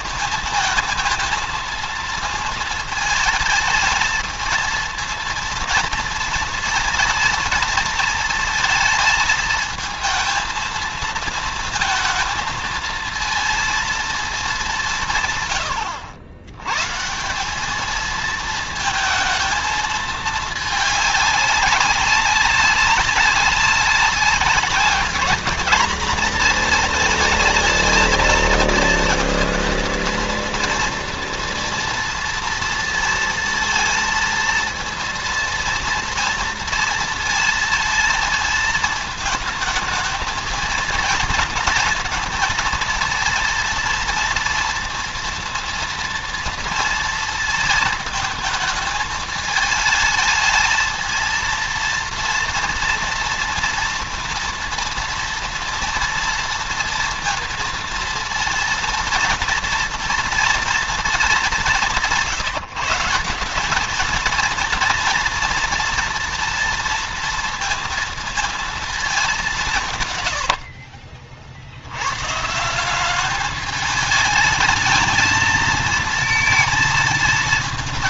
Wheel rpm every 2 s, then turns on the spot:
220, 220, 230, 230, 220, 230, 230, 200, 120, 220, 210, 190, 200, 220, 230, 230, 230, 230, 230, 230, 230, 220, 230, 230, 220, 220, 230, 230, 230, 230, 230, 160, 230, 230, 220, 70, 180, 210, 220.
70-72